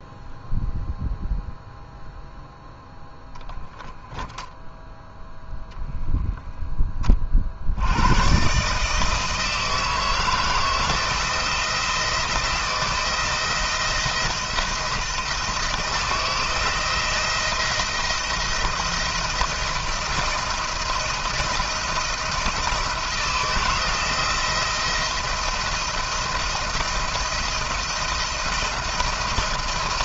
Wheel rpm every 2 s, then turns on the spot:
0, 0, 0, 10, 150, 170, 160, 170, 170, 170, 170, 160, 170, 170, 170.
none